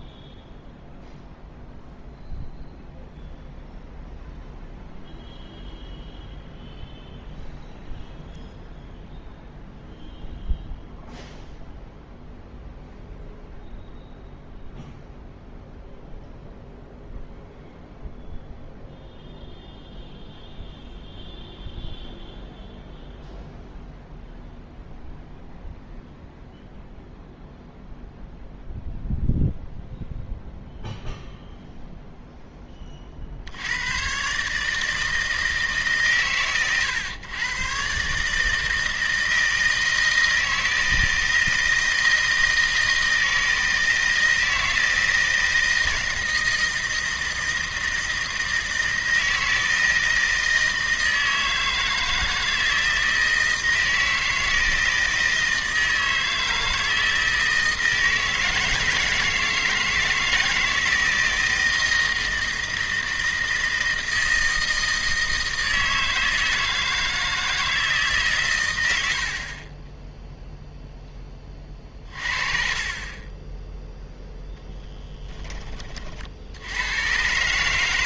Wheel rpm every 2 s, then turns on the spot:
0, 0, 0, 0, 0, 0, 0, 0, 0, 0, 0, 0, 0, 0, 0, 0, 20, 160, 100, 160, 160, 160, 160, 160, 160, 160, 160, 160, 160, 160, 160, 160, 160, 160, 110, 0, 30, 10, 90.
none